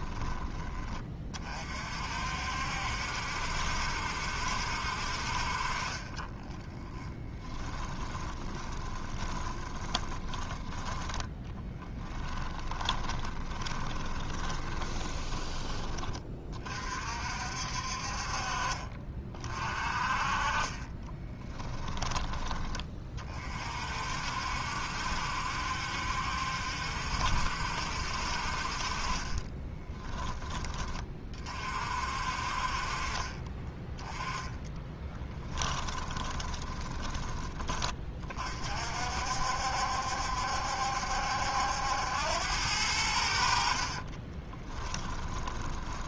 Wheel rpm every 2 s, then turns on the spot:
20, 60, 60, 20, 10, 10, 20, 20, 40, 40, 30, 30, 70, 70, 40, 20, 40, 30, 20, 50, 70, 90, 20.
6-10 12-16 20-22 34-38 44-46